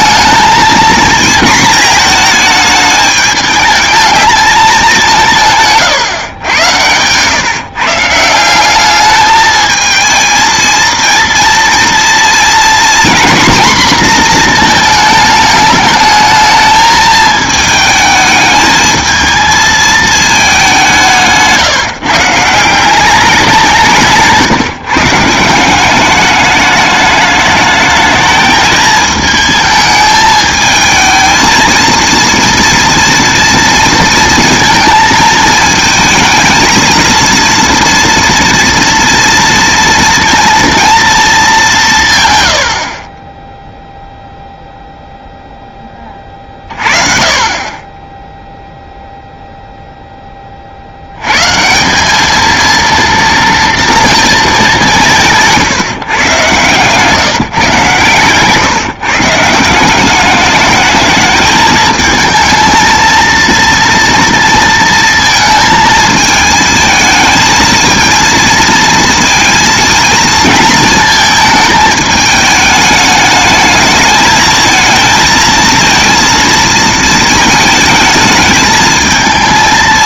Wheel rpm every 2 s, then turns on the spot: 230, 220, 210, 100, 180, 230, 240, 230, 220, 210, 200, 170, 160, 210, 220, 220, 230, 220, 220, 230, 230, 100, 0, 30, 0, 40, 230, 200, 140, 140, 210, 220, 230, 220, 230, 220, 210, 220, 230, 220.
none